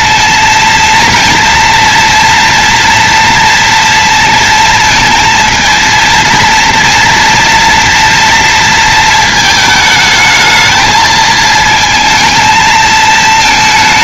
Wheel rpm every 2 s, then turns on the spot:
230, 230, 230, 230, 230, 220, 220.
none